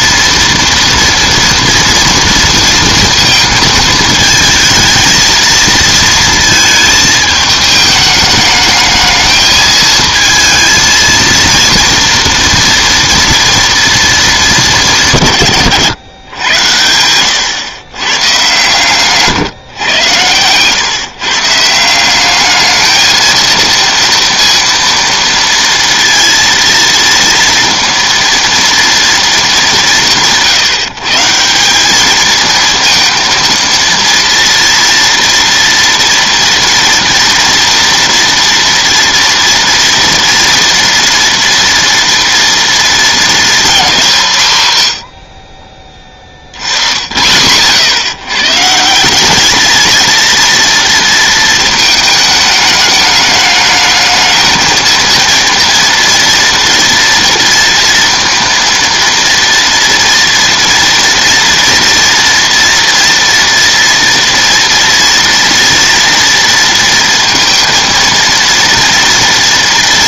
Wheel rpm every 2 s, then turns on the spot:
230, 230, 220, 220, 210, 220, 230, 200, 110, 140, 120, 210, 230, 230, 230, 160, 230, 230, 230, 230, 230, 230, 150, 20, 140, 230, 210, 220, 230, 230, 230, 230, 240, 230, 230.
none